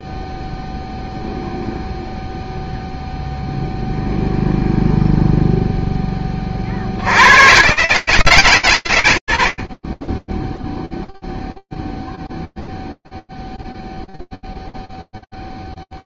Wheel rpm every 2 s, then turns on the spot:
0, 0, 0, 40, 130, 0, 0, 0.
none